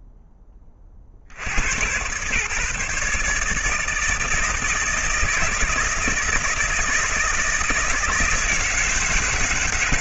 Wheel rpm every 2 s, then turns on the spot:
40, 150, 160, 160, 170.
none